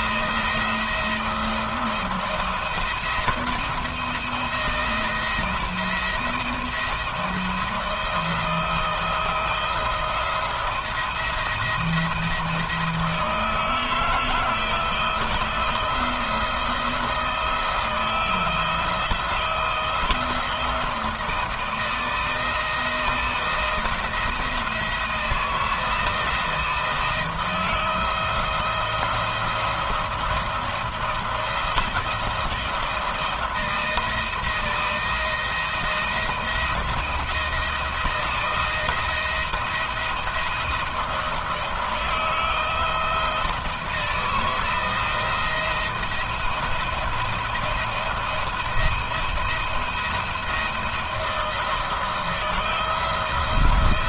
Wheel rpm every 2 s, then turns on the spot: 170, 170, 170, 160, 160, 170, 160, 160, 170, 160, 160, 160, 170, 160, 170, 170, 160, 170, 170, 170, 170, 160, 160, 170, 170, 170, 170.
none